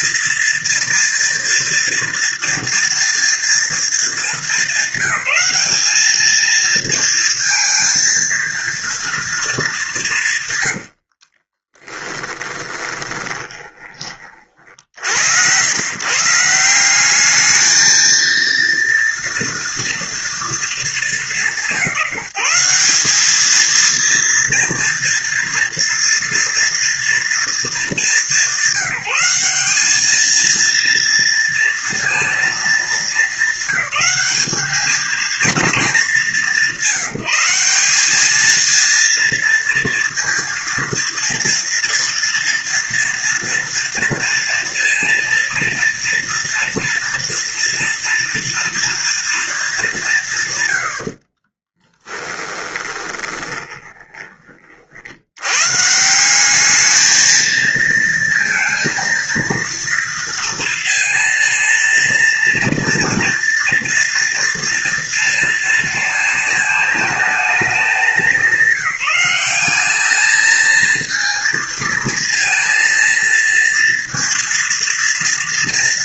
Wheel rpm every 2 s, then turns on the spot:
230, 230, 210, 220, 230, 130, 20, 40, 160, 230, 230, 160, 230, 230, 200, 220, 230, 210, 200, 210, 230, 230, 230, 230, 230, 140, 20, 30, 180, 230, 230, 230, 230, 230, 190, 220, 230, 230.
12-14 52-54